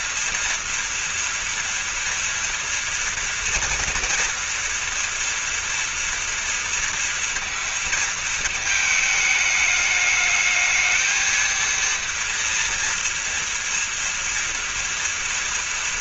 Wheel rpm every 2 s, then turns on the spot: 230, 230, 230, 230, 220, 220, 230, 230.
none